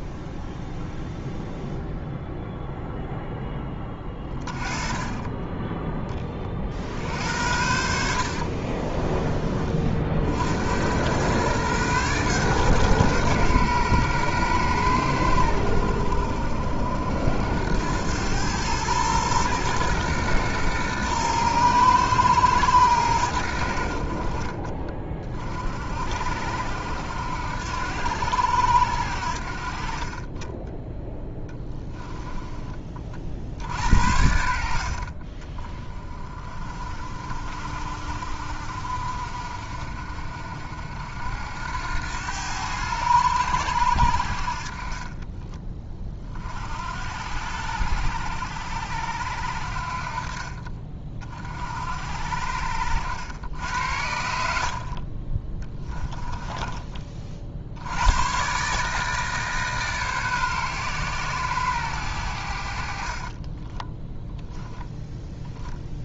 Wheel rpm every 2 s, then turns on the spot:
0, 0, 20, 50, 30, 90, 130, 110, 60, 110, 120, 110, 40, 80, 80, 10, 30, 60, 40, 60, 60, 90, 50, 60, 80, 40, 70, 60, 20, 140, 130, 70, 0.
8-10 30-32 54-56